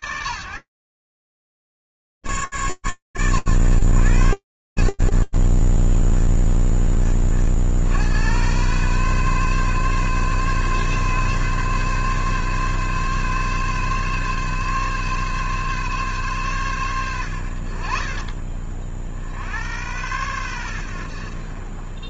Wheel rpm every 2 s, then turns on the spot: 30, 120, 60, 30, 130, 140, 140, 140, 80, 80, 60.
none